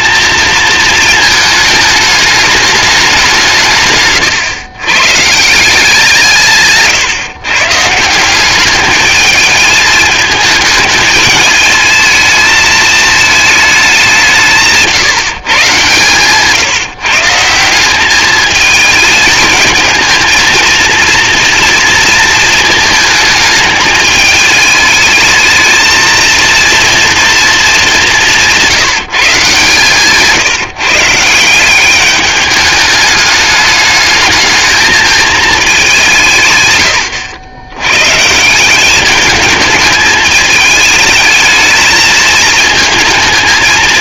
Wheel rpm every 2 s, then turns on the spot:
230, 210, 110, 150, 210, 220, 220, 160, 160, 220, 230, 220, 220, 230, 180, 150, 200, 220, 130, 190, 220, 220.
none